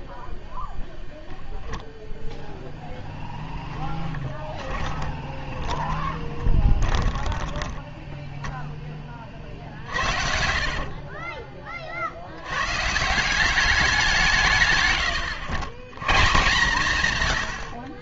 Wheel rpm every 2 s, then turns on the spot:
0, 0, 20, 20, 20, 60, 100, 130, 160.
4-8 10-12